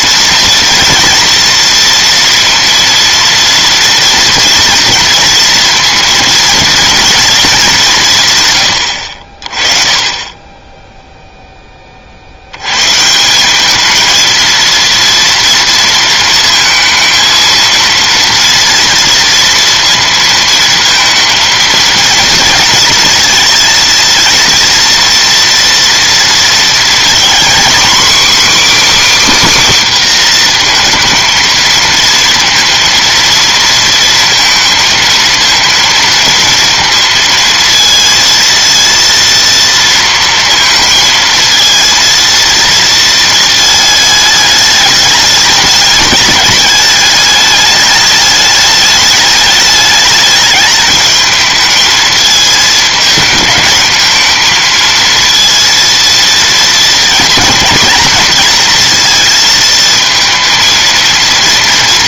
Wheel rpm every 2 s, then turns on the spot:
230, 230, 230, 230, 130, 20, 80, 230, 230, 230, 220, 230, 230, 230, 280, 240, 230, 230, 230, 230, 230, 230, 220, 210, 210, 210, 220, 220, 230, 230, 230.
none